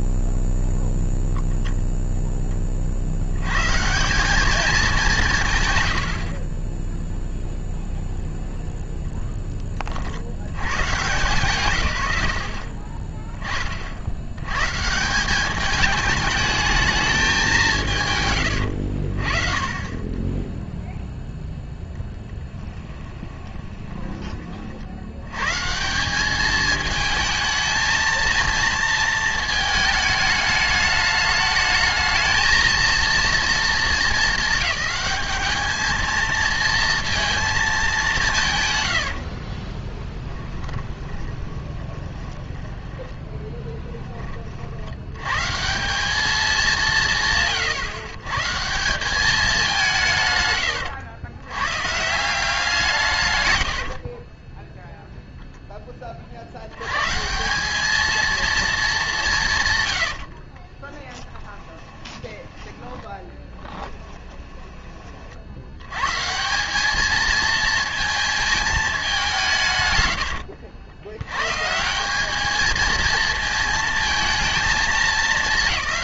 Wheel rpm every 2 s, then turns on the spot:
0, 50, 200, 10, 0, 120, 30, 150, 220, 70, 0, 10, 60, 220, 230, 210, 230, 210, 230, 100, 20, 10, 80, 210, 170, 100, 150, 0, 110, 220, 20, 10, 30, 220, 200, 90, 230, 220.
6-8 22-24 38-44 50-52 60-64